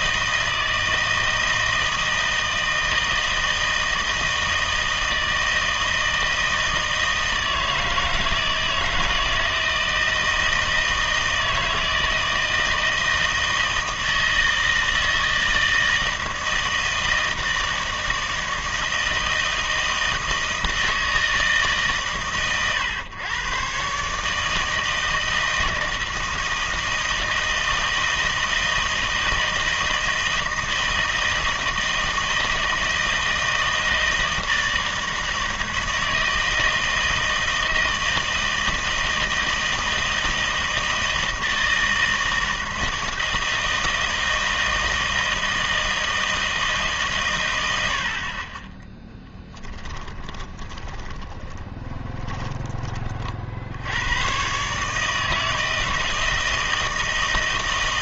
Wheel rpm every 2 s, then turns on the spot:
160, 160, 160, 160, 160, 160, 160, 160, 160, 160, 160, 120, 160, 160, 160, 160, 160, 160, 160, 160, 160, 160, 160, 160, 20, 20, 30, 140, 160.
50-52